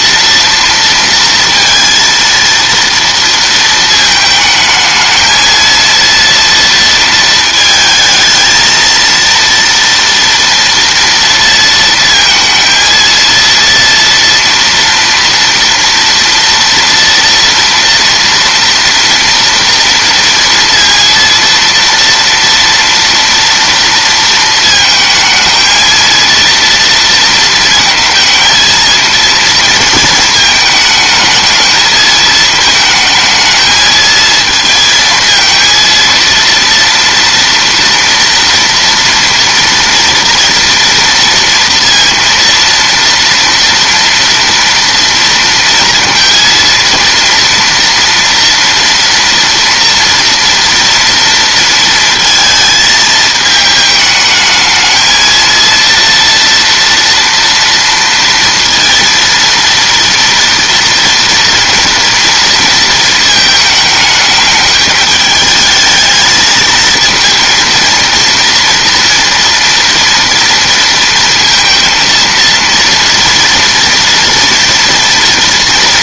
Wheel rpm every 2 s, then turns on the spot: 230, 230, 220, 230, 230, 230, 230, 230, 230, 230, 230, 230, 220, 230, 220, 220, 220, 230, 230, 230, 230, 230, 230, 230, 230, 230, 220, 220, 230, 230, 230, 230, 210, 220, 230, 230, 230, 230.
none